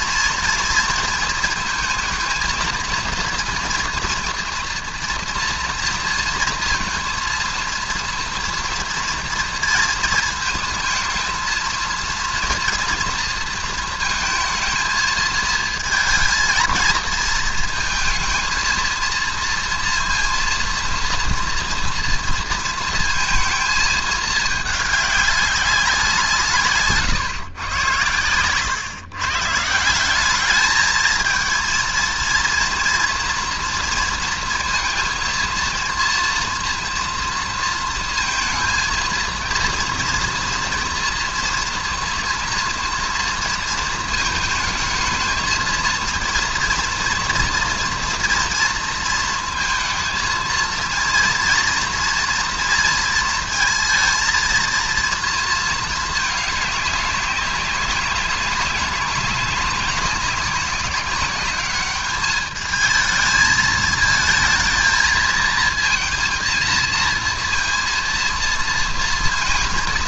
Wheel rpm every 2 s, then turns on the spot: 230, 230, 240, 230, 230, 230, 230, 220, 230, 230, 230, 230, 210, 170, 120, 200, 230, 230, 230, 230, 240, 230, 220, 230, 230, 230, 230, 230, 210, 200, 190, 210, 220, 230, 230.
none